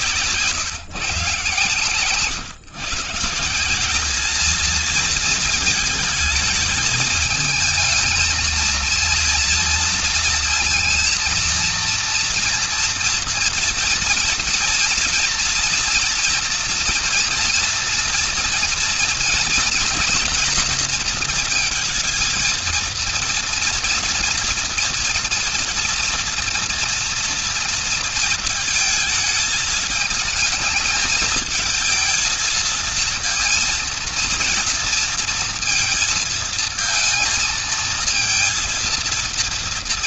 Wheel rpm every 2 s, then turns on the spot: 140, 140, 220, 220, 230, 230, 230, 230, 230, 230, 230, 230, 240, 240, 220, 220, 230, 230, 230, 230.
none